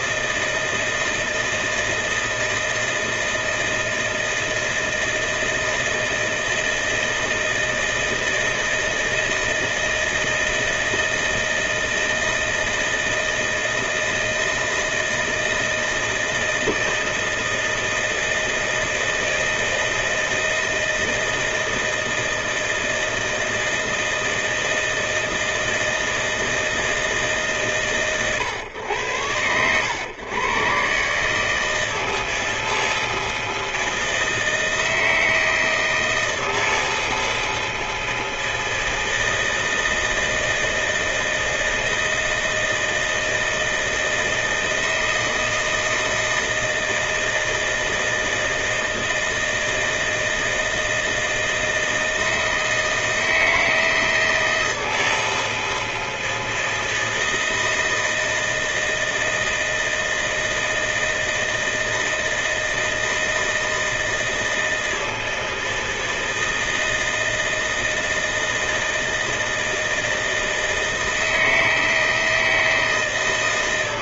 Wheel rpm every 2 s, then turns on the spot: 160, 160, 160, 160, 160, 160, 160, 160, 160, 160, 160, 160, 160, 160, 120, 120, 160, 160, 160, 160, 160, 160, 160, 160, 160, 160, 160, 160, 160, 160, 160, 160, 160, 160, 160, 160, 160.
none